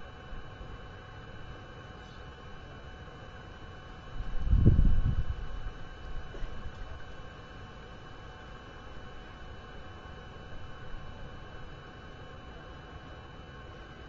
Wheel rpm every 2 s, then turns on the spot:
0, 0, 0, 0, 0, 0, 0.
none